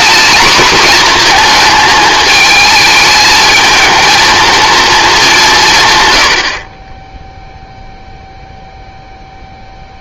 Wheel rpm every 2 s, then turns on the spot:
230, 220, 230, 30, 0.
none